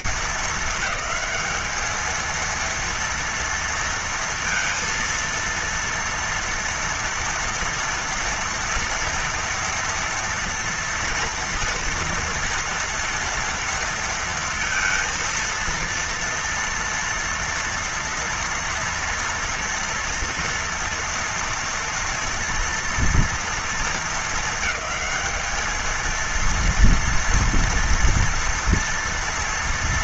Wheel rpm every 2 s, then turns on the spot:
230, 220, 230, 230, 230, 230, 230, 230, 230, 230, 230, 230, 220, 230, 230.
none